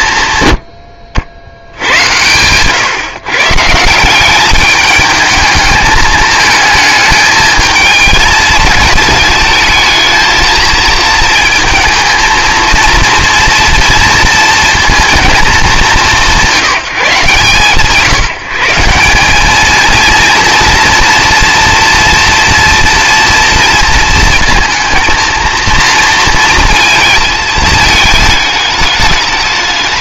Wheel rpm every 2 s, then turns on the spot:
90, 120, 210, 220, 220, 230, 230, 230, 170, 160, 240, 230, 230, 230, 210.
none